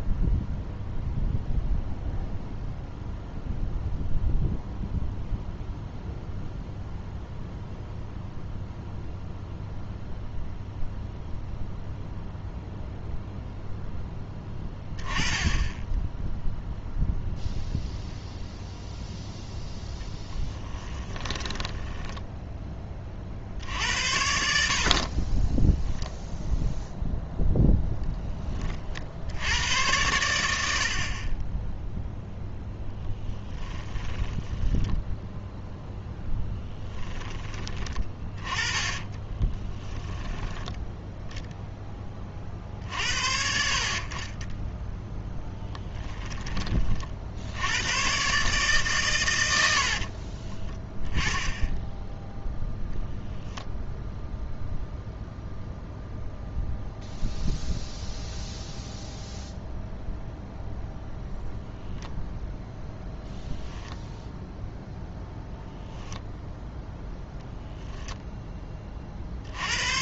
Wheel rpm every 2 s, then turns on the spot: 0, 0, 0, 0, 0, 0, 0, 10, 0, 0, 10, 20, 50, 0, 30, 70, 0, 10, 10, 20, 10, 50, 10, 30, 140, 20, 0, 0, 0, 0, 0, 0, 0, 0, 20.
20-22 34-42 44-46